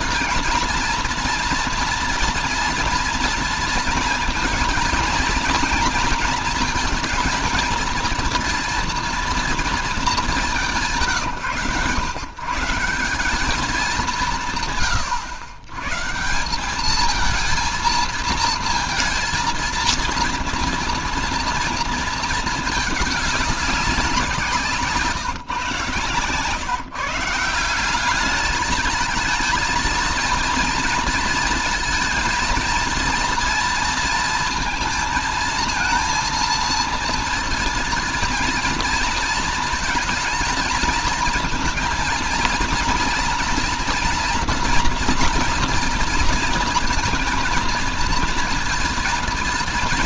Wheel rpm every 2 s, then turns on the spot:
230, 230, 230, 230, 230, 180, 150, 120, 200, 220, 230, 210, 160, 140, 210, 230, 230, 230, 230, 230, 230, 230, 230, 230, 230.
none